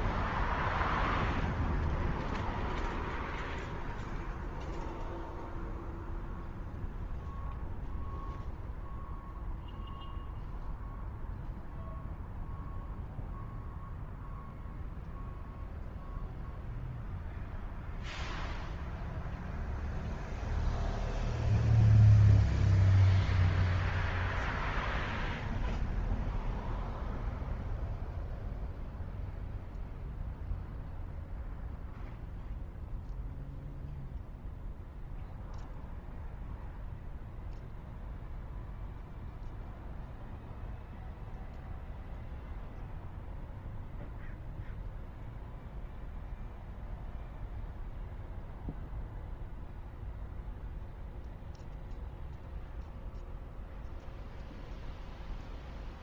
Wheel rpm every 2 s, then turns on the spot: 0, 0, 0, 0, 0, 0, 0, 0, 0, 0, 0, 0, 0, 0, 0, 0, 0, 0, 0, 0, 0, 0, 0, 0, 0, 0, 0, 0.
none